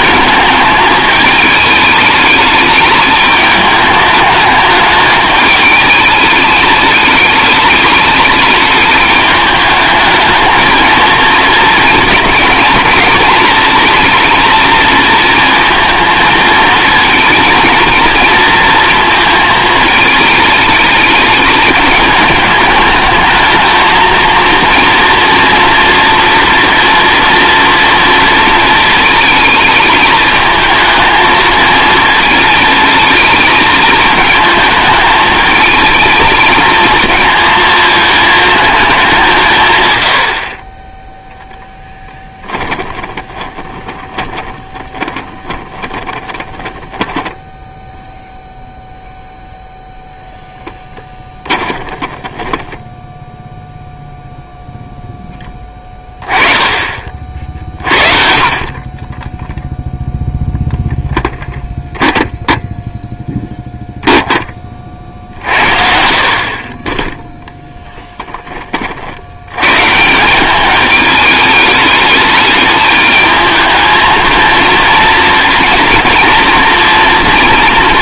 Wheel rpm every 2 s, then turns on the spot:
210, 210, 210, 210, 210, 230, 210, 230, 220, 230, 210, 220, 230, 230, 230, 220, 220, 220, 230, 210, 30, 20, 20, 20, 0, 10, 10, 0, 30, 30, 0, 0, 40, 30, 30, 210, 210, 230, 230.
40-48 52-54